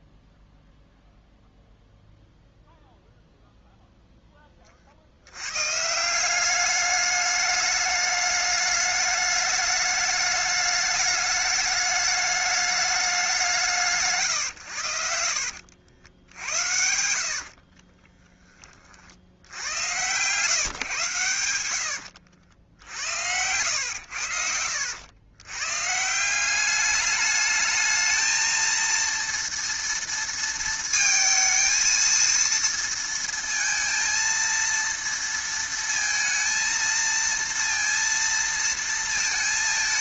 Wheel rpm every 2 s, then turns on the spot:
0, 0, 20, 190, 210, 210, 210, 120, 80, 20, 130, 80, 80, 190, 220, 230, 230, 230, 230, 230.
14-18 22-24